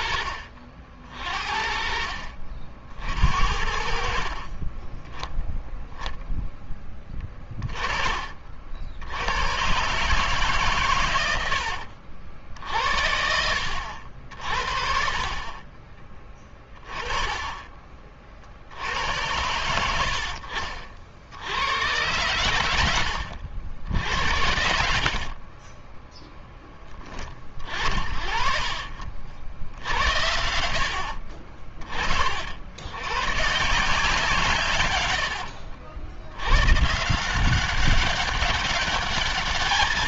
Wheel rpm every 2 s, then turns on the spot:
50, 60, 30, 10, 50, 140, 70, 60, 20, 50, 60, 100, 60, 10, 40, 80, 70, 150, 110, 200.
4-6